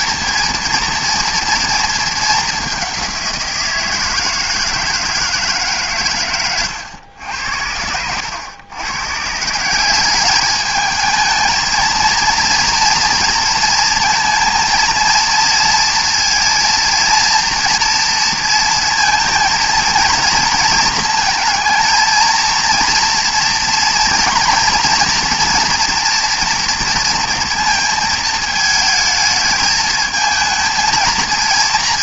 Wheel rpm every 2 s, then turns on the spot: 230, 190, 160, 100, 120, 220, 230, 230, 230, 230, 230, 230, 230, 230, 220, 230.
none